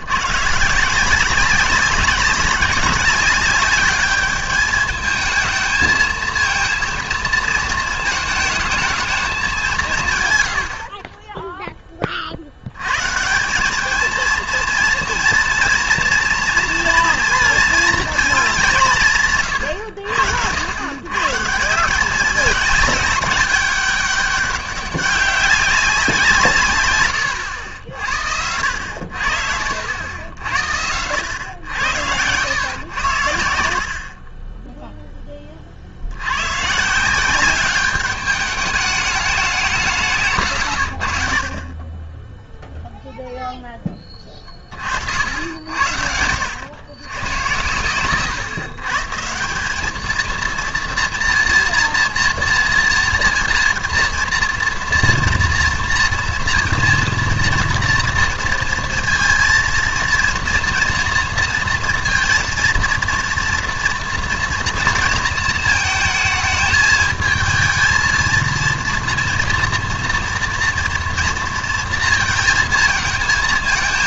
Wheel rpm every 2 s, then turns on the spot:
160, 190, 210, 230, 220, 70, 100, 230, 230, 190, 100, 200, 200, 160, 70, 70, 100, 10, 140, 210, 110, 0, 50, 100, 140, 230, 230, 230, 230, 230, 230, 230, 230, 220, 230, 230, 230.
32-36